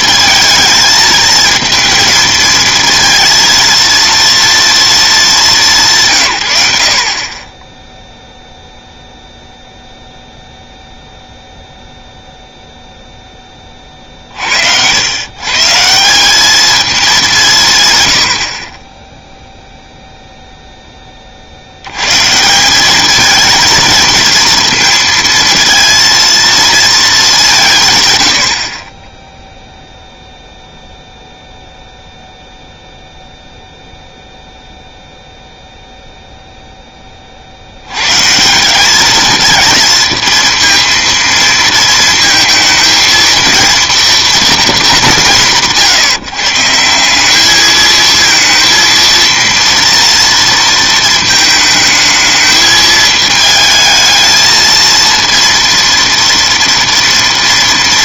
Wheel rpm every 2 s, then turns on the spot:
220, 230, 230, 100, 0, 0, 0, 70, 210, 40, 0, 180, 230, 230, 50, 0, 0, 0, 0, 180, 230, 230, 220, 150, 230, 230, 220, 220, 230.
none